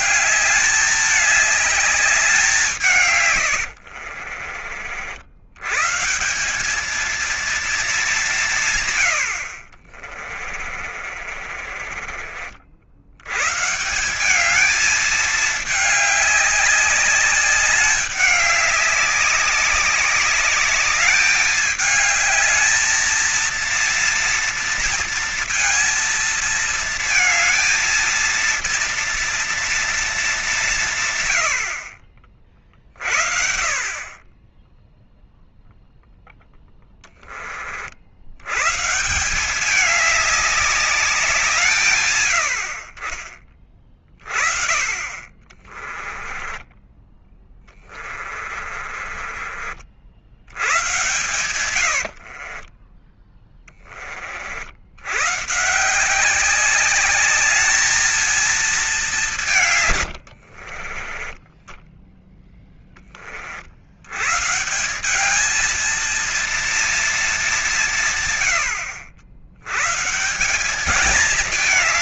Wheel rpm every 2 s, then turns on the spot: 220, 180, 50, 190, 160, 40, 50, 200, 200, 200, 200, 220, 230, 230, 230, 180, 50, 20, 10, 110, 210, 70, 40, 20, 40, 90, 40, 70, 190, 210, 70, 10, 150, 230, 110, 180.
10-12 46-50 52-54 60-62